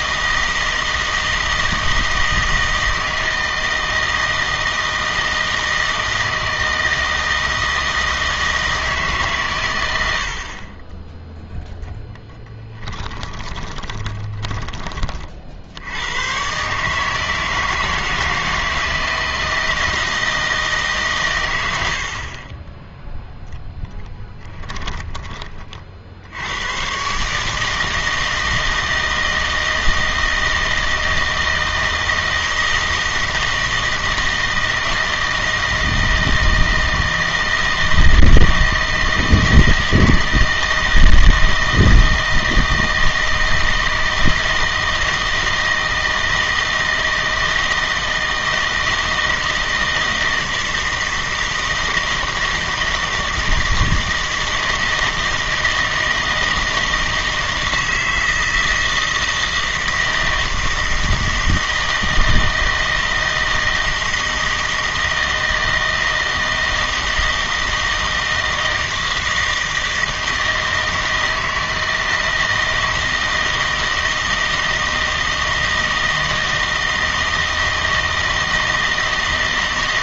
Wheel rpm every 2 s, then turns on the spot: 160, 160, 160, 160, 160, 40, 10, 20, 130, 160, 160, 20, 10, 100, 160, 160, 160, 160, 160, 160, 160, 160, 160, 160, 160, 160, 160, 160, 160, 160, 160, 160, 160, 160, 160, 160, 160, 160, 160, 160.
12-16 24-26